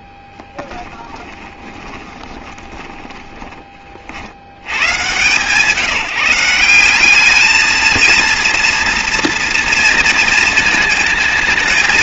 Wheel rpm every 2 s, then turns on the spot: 10, 20, 110, 180, 230, 220.
0-4